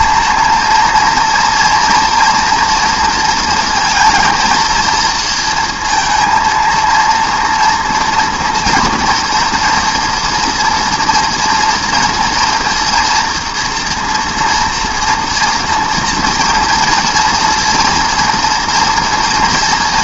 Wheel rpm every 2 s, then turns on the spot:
230, 230, 230, 230, 240, 230, 240, 230, 240, 230.
none